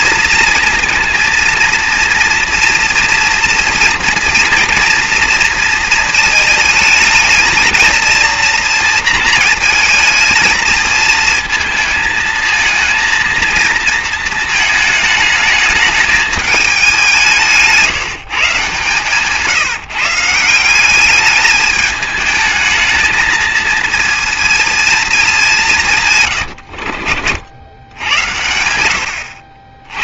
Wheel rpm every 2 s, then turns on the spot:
230, 230, 230, 220, 230, 220, 230, 220, 180, 140, 200, 220, 210, 60, 90.
18-20